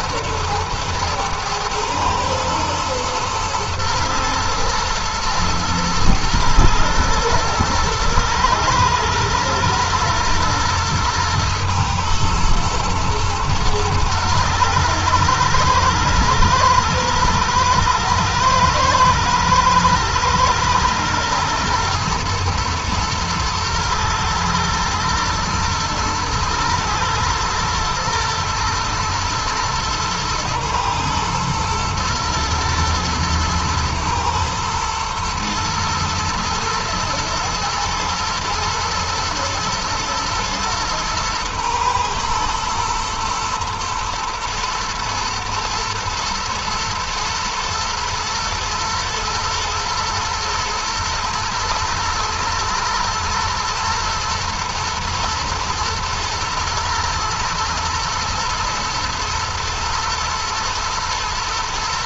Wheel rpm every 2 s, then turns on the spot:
110, 110, 110, 110, 120, 110, 110, 110, 110, 110, 120, 110, 110, 110, 120, 120, 110, 110, 120, 120, 120, 120, 110, 110, 110, 110, 120, 110, 120, 110, 120.
none